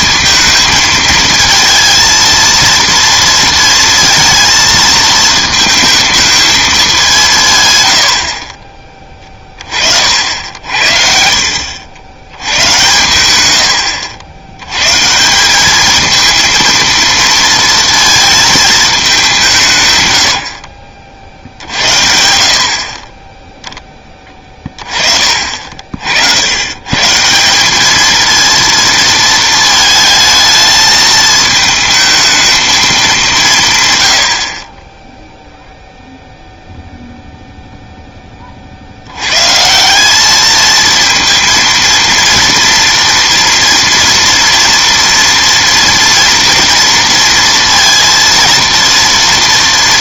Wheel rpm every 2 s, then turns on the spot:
210, 230, 230, 220, 50, 70, 110, 80, 220, 220, 70, 20, 20, 100, 230, 220, 220, 50, 0, 40, 220, 230, 230, 230, 230.
none